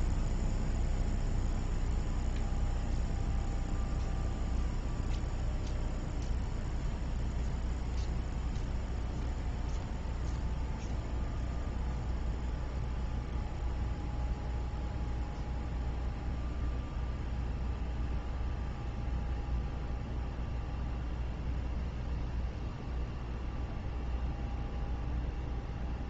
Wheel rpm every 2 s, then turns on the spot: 0, 0, 0, 0, 0, 0, 0, 0, 0, 0, 0, 0, 0.
none